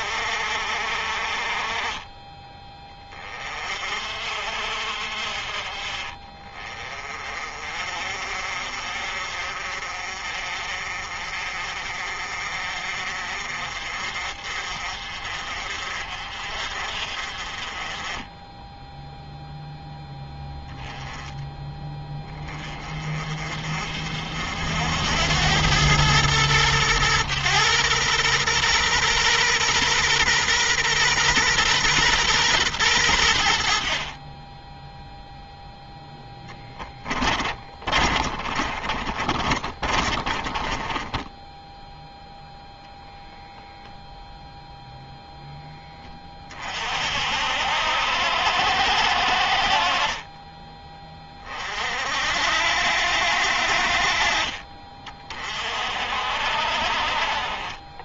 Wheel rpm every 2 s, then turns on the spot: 40, 30, 50, 30, 50, 50, 50, 50, 40, 0, 10, 30, 80, 120, 120, 130, 110, 0, 20, 30, 20, 0, 0, 50, 80, 30, 80, 40, 40.
36-42